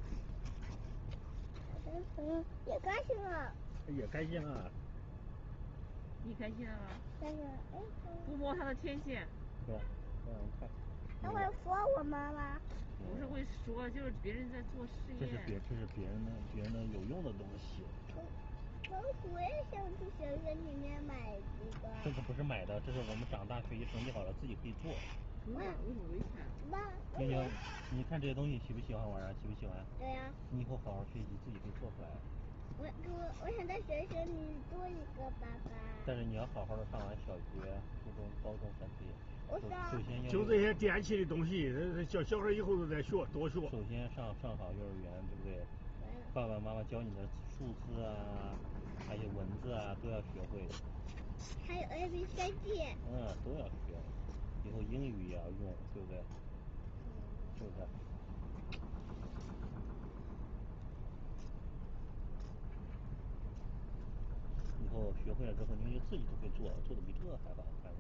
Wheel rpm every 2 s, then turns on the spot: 0, 0, 0, 0, 0, 0, 0, 0, 0, 0, 0, 0, 0, 0, 0, 0, 0, 0, 0, 0, 0, 0, 0, 0, 0, 0, 0, 0, 0, 0, 0, 0, 0, 0.
none